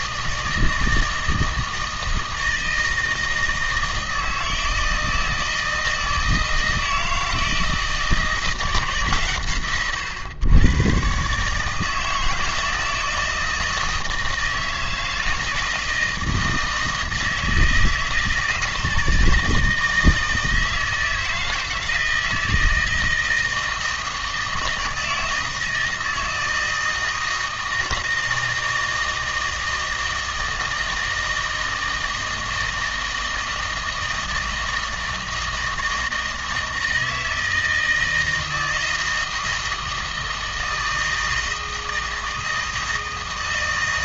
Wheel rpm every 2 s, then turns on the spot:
170, 160, 160, 160, 160, 120, 160, 160, 160, 160, 160, 160, 160, 160, 160, 160, 160, 160, 160, 160, 160, 160.
none